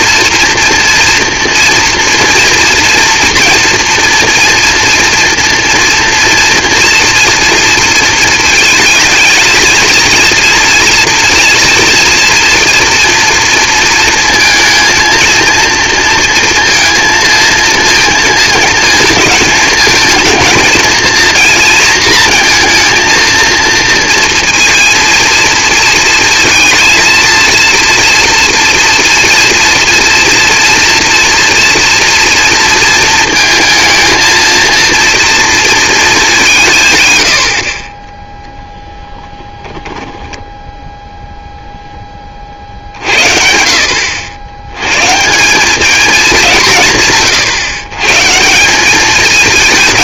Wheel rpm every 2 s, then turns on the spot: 230, 230, 230, 230, 220, 230, 230, 230, 230, 230, 220, 230, 230, 230, 230, 230, 230, 230, 170, 0, 10, 40, 90, 190, 160.
40-42